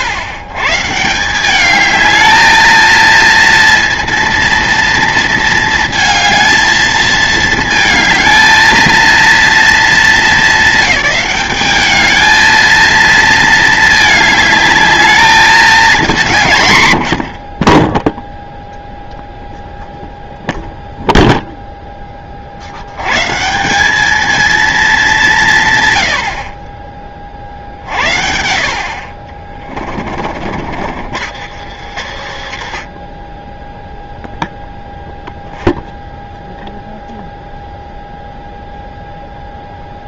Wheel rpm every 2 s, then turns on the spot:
130, 220, 230, 220, 220, 200, 220, 210, 170, 0, 0, 60, 220, 60, 70, 50, 70, 0, 0, 0.
30-34